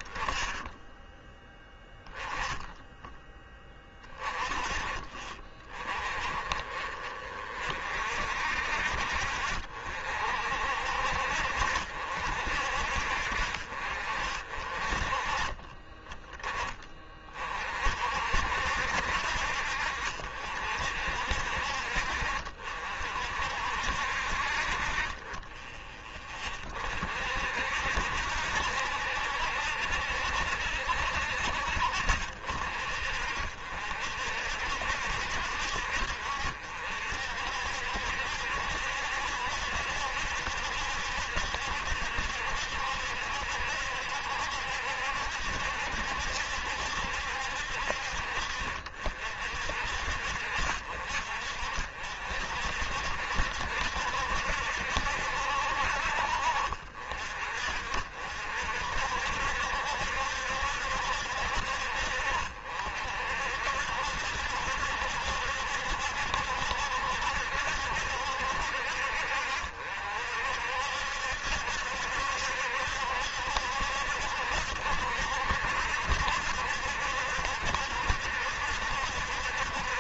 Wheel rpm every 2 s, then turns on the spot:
10, 10, 30, 40, 50, 60, 60, 40, 30, 60, 60, 60, 30, 50, 70, 70, 50, 60, 60, 70, 70, 70, 70, 70, 50, 50, 60, 70, 50, 60, 70, 60, 70, 70, 60, 60, 70, 70, 70, 70.
none